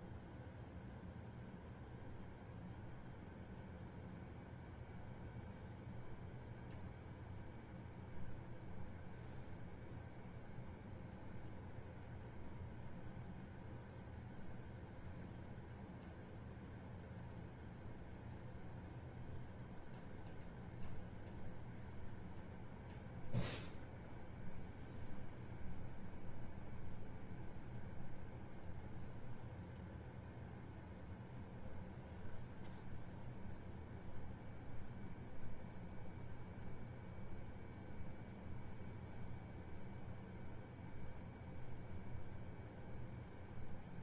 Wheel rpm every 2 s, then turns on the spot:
0, 0, 0, 0, 0, 0, 0, 0, 0, 0, 0, 0, 0, 0, 0, 0, 0, 0, 0, 0, 0, 0.
none